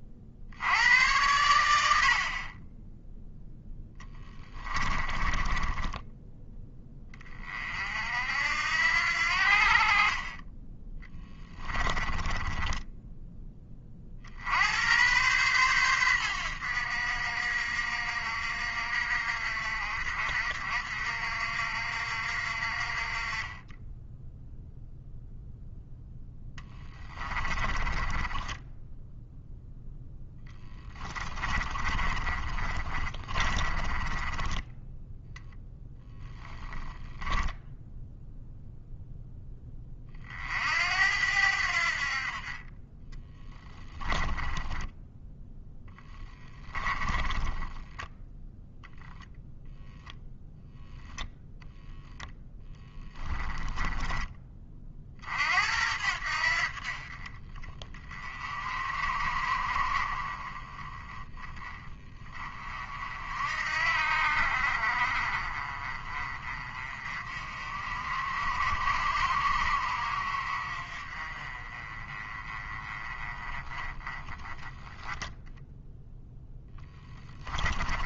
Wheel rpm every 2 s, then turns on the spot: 90, 10, 30, 30, 70, 10, 10, 100, 70, 60, 60, 40, 0, 10, 10, 20, 40, 10, 10, 0, 70, 20, 10, 20, 0, 0, 10, 40, 50, 40, 20, 40, 50, 40, 50, 40, 20, 10, 10.
4-6 10-14 26-34 44-48 52-54 76-78